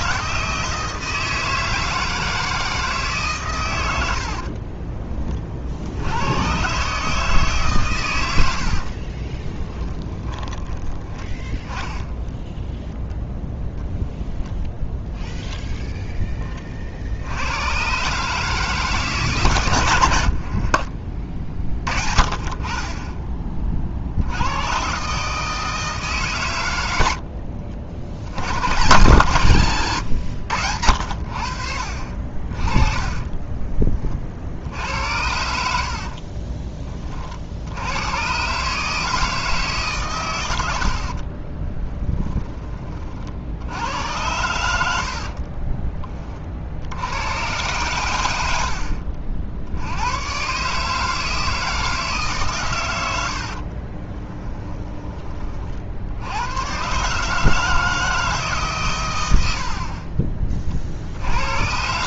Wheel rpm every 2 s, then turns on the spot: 160, 150, 30, 140, 50, 10, 0, 0, 50, 150, 50, 20, 140, 100, 130, 80, 30, 70, 30, 150, 80, 30, 80, 90, 60, 150, 110, 20, 130, 120, 60.
8-10 20-22 32-34 44-46